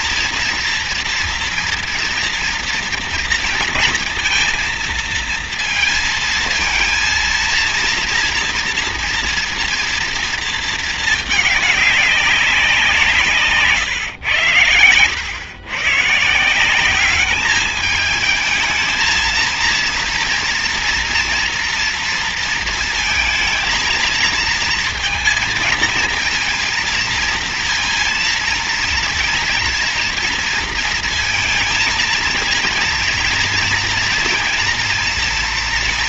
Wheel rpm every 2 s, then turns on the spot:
230, 230, 230, 220, 230, 220, 170, 110, 190, 220, 230, 230, 230, 230, 230, 230, 230, 230.
none